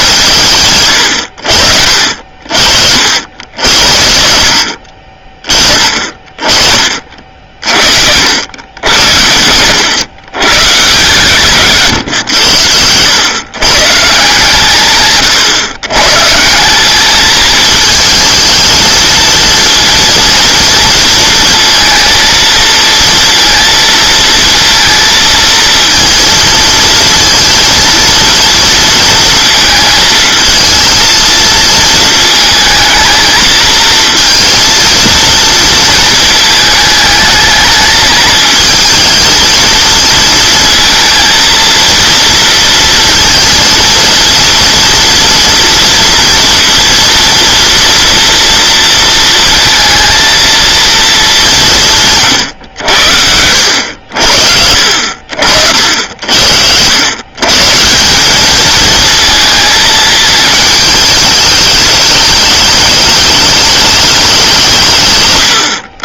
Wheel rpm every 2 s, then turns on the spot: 140, 60, 70, 40, 90, 130, 90, 150, 160, 220, 230, 230, 230, 230, 230, 220, 220, 230, 220, 220, 230, 230, 230, 230, 230, 230, 100, 70, 80, 220, 220, 210, 180.
6-8